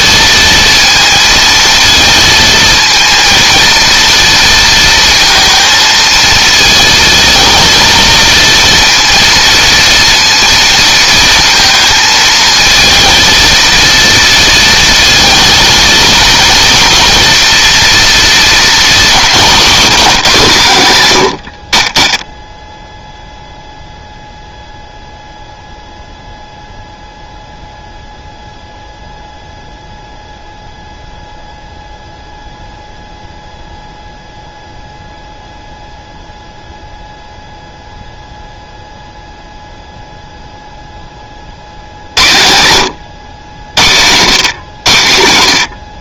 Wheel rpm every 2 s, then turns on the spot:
230, 230, 230, 220, 230, 230, 230, 230, 230, 220, 120, 0, 0, 0, 0, 0, 0, 0, 0, 0, 10, 100, 100.
none